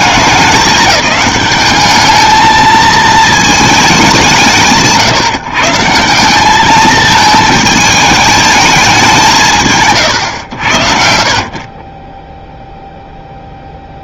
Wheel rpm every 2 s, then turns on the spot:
200, 220, 120, 210, 210, 90, 0.
none